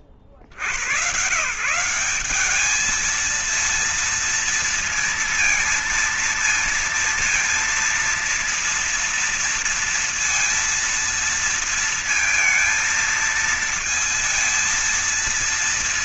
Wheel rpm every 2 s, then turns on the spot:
50, 210, 230, 230, 230, 230, 220, 230.
none